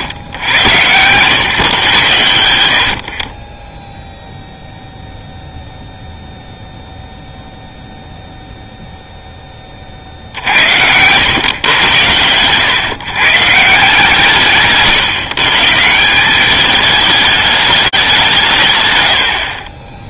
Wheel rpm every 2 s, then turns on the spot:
110, 60, 0, 0, 0, 80, 120, 140, 210, 140.
none